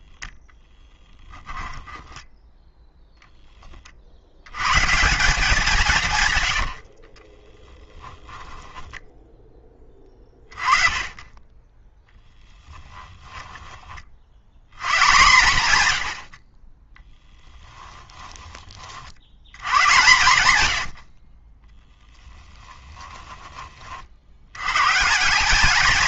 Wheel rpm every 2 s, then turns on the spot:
0, 10, 120, 100, 10, 20, 10, 110, 40, 20, 100, 10, 110.
6-10 12-14 22-24